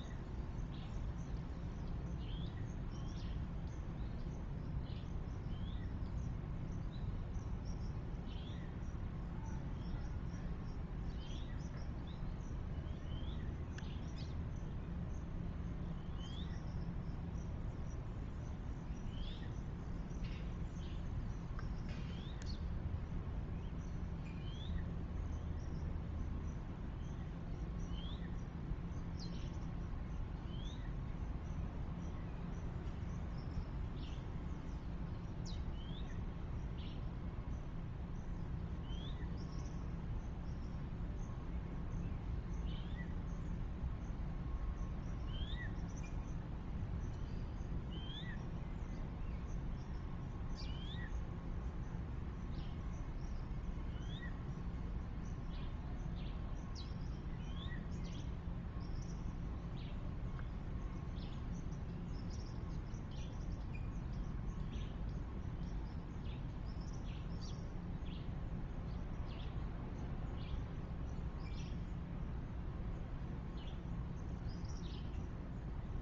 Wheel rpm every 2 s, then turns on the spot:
0, 0, 0, 0, 0, 0, 0, 0, 0, 0, 0, 0, 0, 0, 0, 0, 0, 0, 0, 0, 0, 0, 0, 0, 0, 0, 0, 0, 0, 0, 0, 0, 0, 0, 0, 0, 0, 0.
none